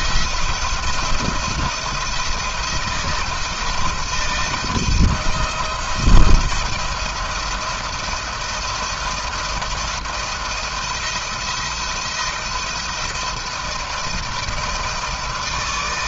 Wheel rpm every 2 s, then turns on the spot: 170, 160, 170, 170, 170, 170, 170, 160.
none